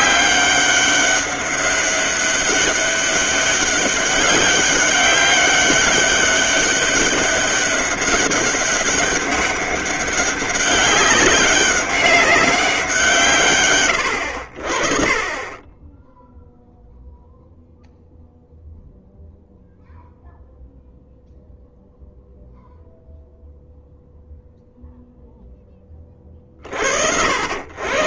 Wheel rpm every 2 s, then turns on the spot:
200, 200, 200, 200, 200, 200, 180, 60, 0, 0, 0, 0, 0, 60.
none